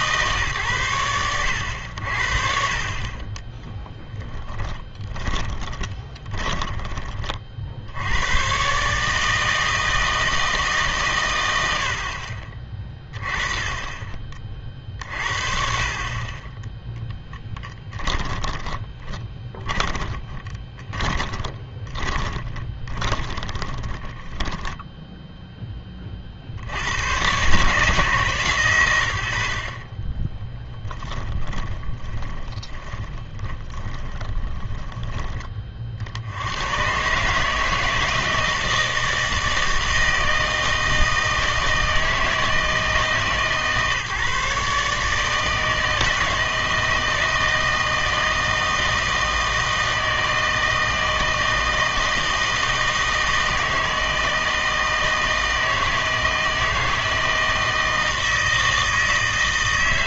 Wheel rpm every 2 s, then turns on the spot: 120, 40, 30, 20, 130, 160, 30, 40, 20, 20, 20, 20, 10, 70, 110, 10, 20, 10, 110, 160, 160, 160, 140, 160, 160, 160, 160, 160, 160, 160.
4-8 18-24 30-36